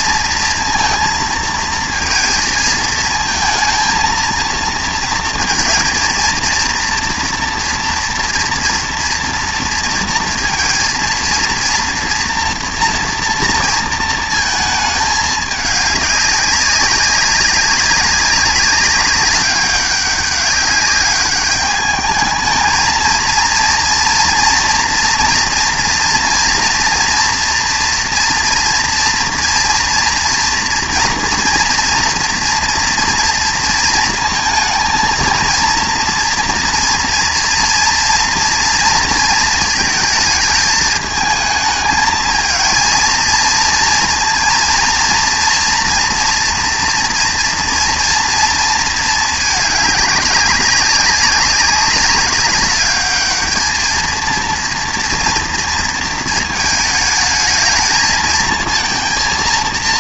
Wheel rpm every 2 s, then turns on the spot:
230, 220, 230, 240, 230, 230, 240, 210, 190, 200, 200, 220, 230, 240, 230, 230, 230, 230, 230, 230, 220, 230, 230, 230, 220, 200, 210, 230, 220, 230.
none